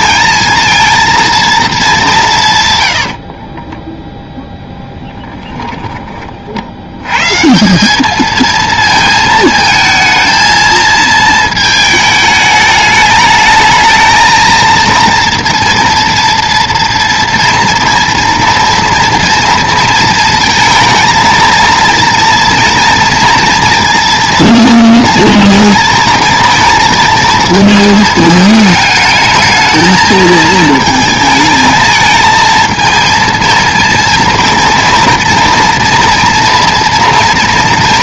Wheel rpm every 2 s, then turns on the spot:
220, 140, 0, 60, 220, 220, 210, 230, 230, 230, 220, 230, 230, 230, 220, 220, 220, 230, 240.
none